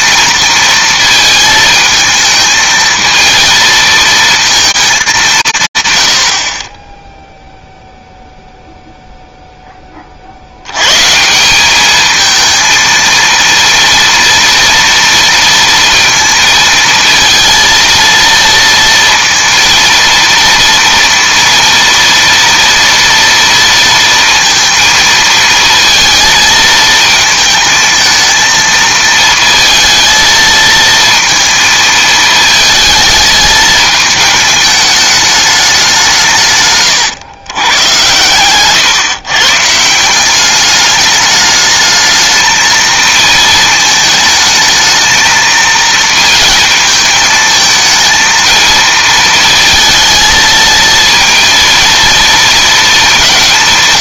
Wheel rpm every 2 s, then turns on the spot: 220, 220, 220, 40, 0, 90, 220, 230, 230, 230, 230, 230, 230, 220, 220, 220, 220, 210, 130, 120, 200, 220, 220, 220, 230, 230, 230.
38-40